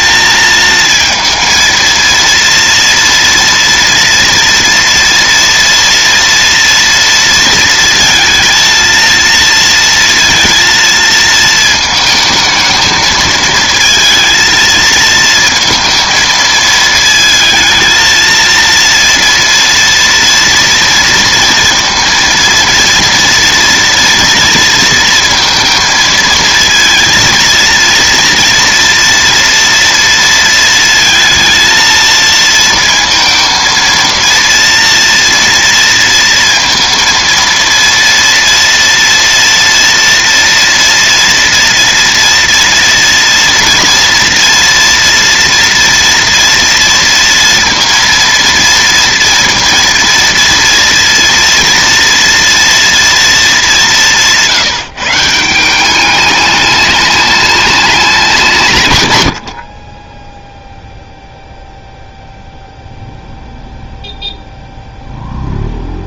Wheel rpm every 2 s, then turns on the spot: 220, 230, 230, 230, 230, 230, 220, 230, 220, 230, 230, 230, 230, 230, 230, 220, 230, 230, 230, 230, 230, 230, 230, 230, 230, 230, 230, 150, 210, 120, 0, 0, 0.
none